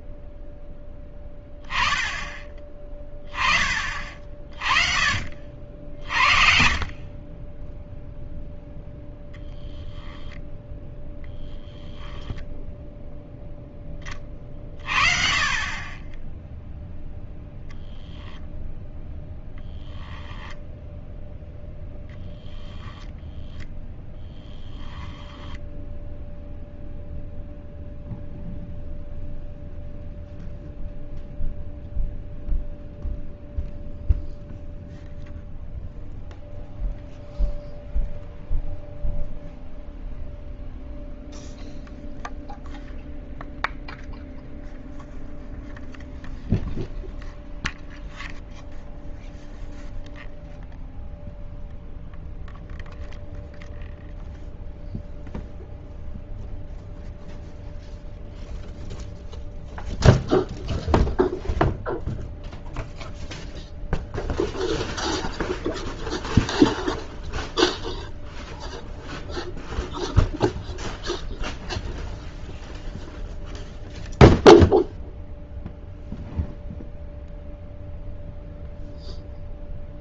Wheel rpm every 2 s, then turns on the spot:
0, 20, 40, 50, 0, 10, 0, 40, 0, 0, 0, 10, 10, 0, 0, 0, 0, 0, 0, 0, 0, 0, 0, 0, 0, 0, 0, 0, 0, 0, 0, 0, 0, 0, 0, 0, 0, 0, 0, 0.
10-12 22-26